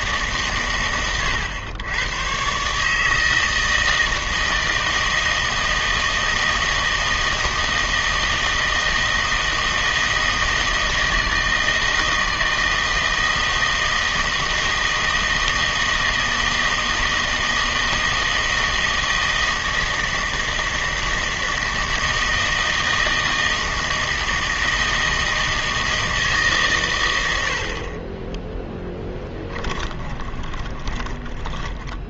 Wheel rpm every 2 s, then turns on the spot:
120, 150, 160, 160, 160, 160, 160, 160, 160, 160, 160, 160, 160, 120, 10, 20.
28-32